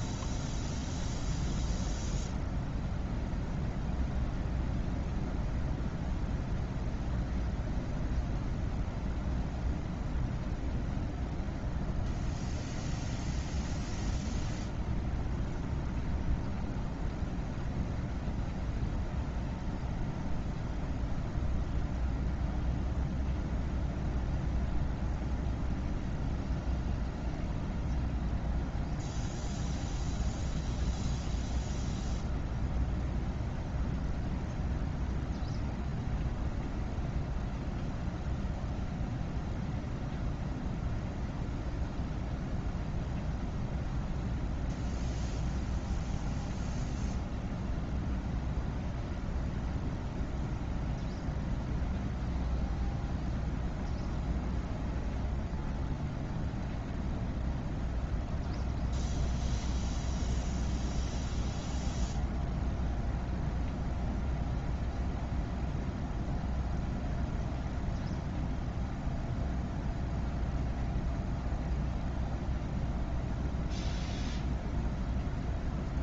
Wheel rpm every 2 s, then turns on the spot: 0, 0, 0, 0, 0, 0, 0, 0, 0, 0, 0, 0, 0, 0, 0, 0, 0, 0, 0, 0, 0, 0, 0, 0, 0, 0, 0, 0, 0, 0, 0, 0, 0, 0, 0, 0, 0, 0.
none